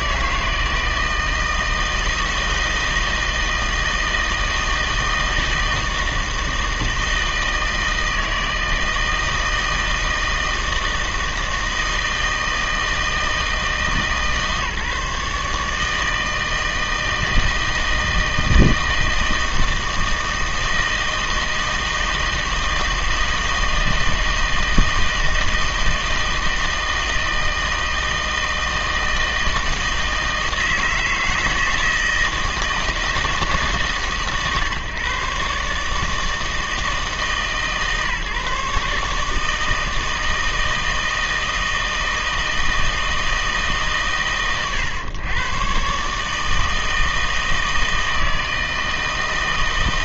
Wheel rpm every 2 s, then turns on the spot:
160, 160, 160, 160, 160, 160, 160, 150, 160, 160, 160, 160, 160, 160, 160, 160, 160, 130, 160, 150, 160, 160, 120, 160, 160.
none